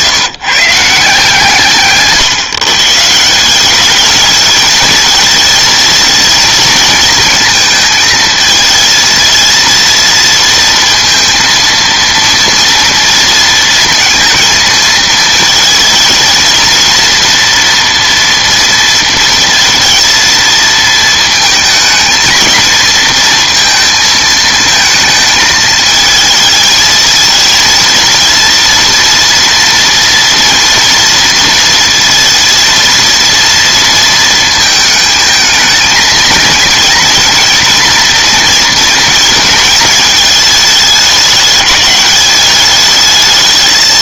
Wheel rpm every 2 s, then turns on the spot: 150, 150, 220, 230, 220, 230, 230, 230, 230, 230, 220, 230, 230, 220, 230, 230, 230, 220, 230, 230, 210, 210.
none